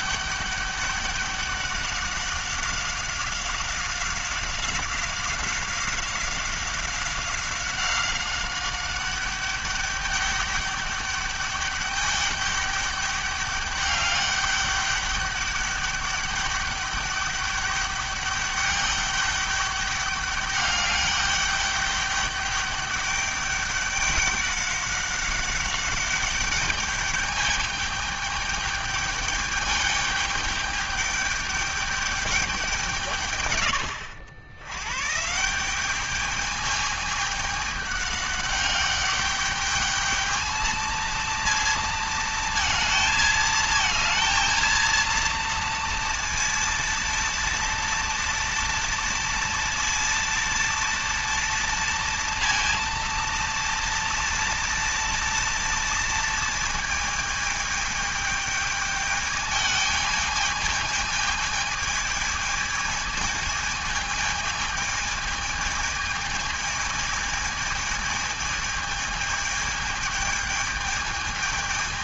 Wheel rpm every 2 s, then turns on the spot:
200, 190, 190, 190, 190, 200, 200, 200, 200, 200, 200, 200, 200, 200, 210, 210, 200, 80, 210, 200, 220, 220, 230, 230, 230, 230, 230, 230, 230, 210, 220, 220, 220, 220, 220, 220.
none